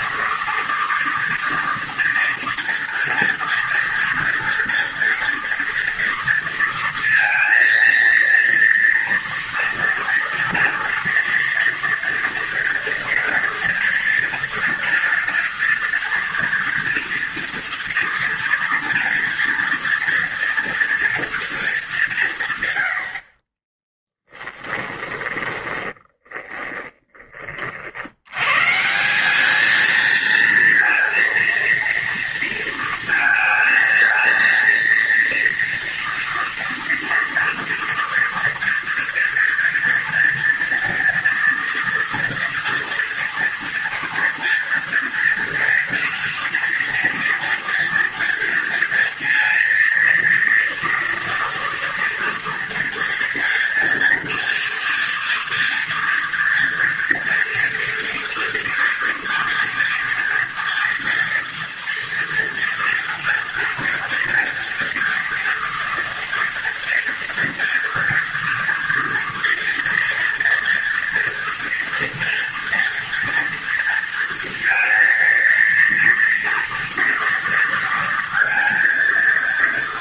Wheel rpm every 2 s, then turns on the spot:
230, 230, 230, 230, 230, 230, 230, 240, 230, 230, 230, 120, 10, 20, 140, 230, 230, 230, 240, 230, 230, 240, 230, 230, 230, 230, 230, 230, 240, 230, 230, 230, 230, 230, 230, 240, 230, 230, 230, 230.
24-28